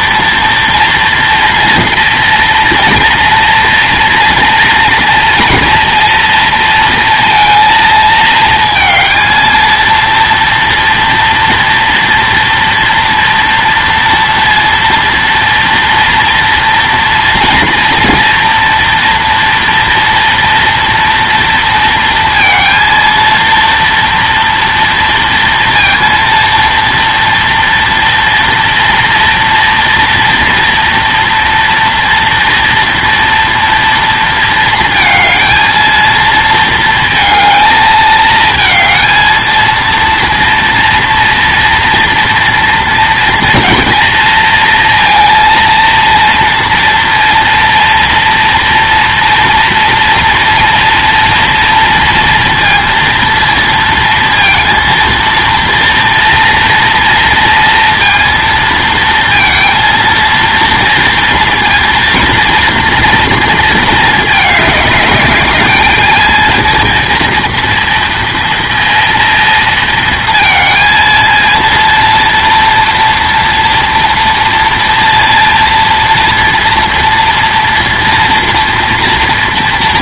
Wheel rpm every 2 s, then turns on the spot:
230, 230, 230, 230, 220, 230, 230, 230, 230, 230, 230, 230, 230, 230, 240, 230, 230, 230, 230, 220, 230, 230, 230, 230, 230, 230, 230, 230, 230, 230, 230, 230, 210, 230, 230, 230, 230, 230, 230, 230.
none